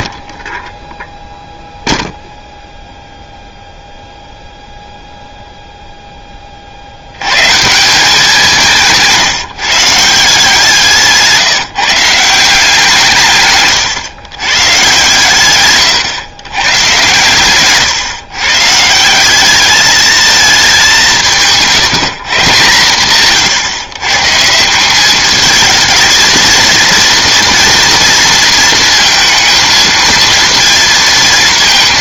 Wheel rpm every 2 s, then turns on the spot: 0, 0, 0, 40, 180, 170, 170, 130, 120, 160, 210, 150, 170, 230, 230, 230.
none